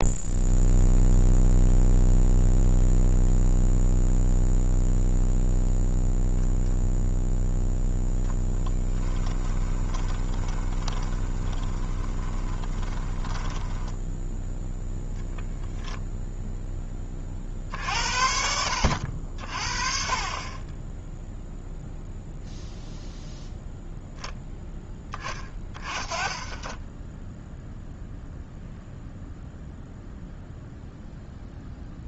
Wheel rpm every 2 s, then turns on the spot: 0, 0, 0, 0, 10, 20, 20, 0, 10, 70, 20, 0, 10, 20, 0, 0.
8-14